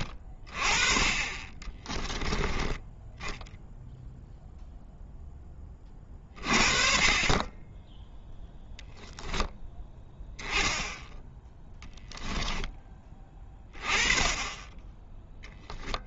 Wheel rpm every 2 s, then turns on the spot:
30, 10, 0, 40, 0, 10, 10, 10.
none